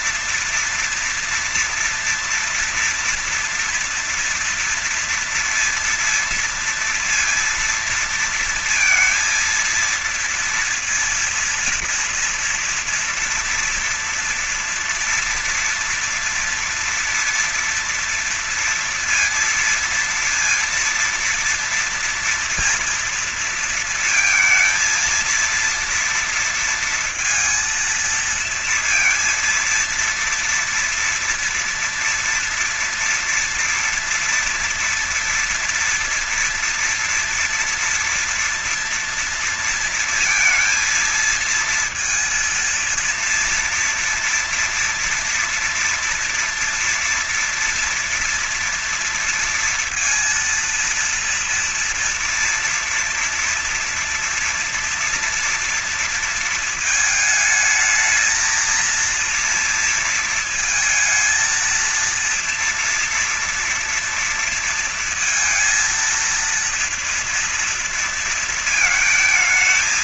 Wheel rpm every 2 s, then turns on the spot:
230, 230, 230, 230, 230, 230, 240, 240, 230, 230, 230, 230, 220, 230, 230, 230, 230, 230, 230, 230, 230, 230, 230, 230, 240, 230, 230, 230, 230, 220, 230, 230, 230, 230, 230.
none